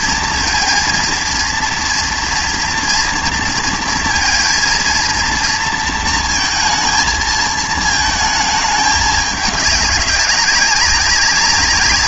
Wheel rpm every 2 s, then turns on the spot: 230, 230, 230, 230, 220, 200.
none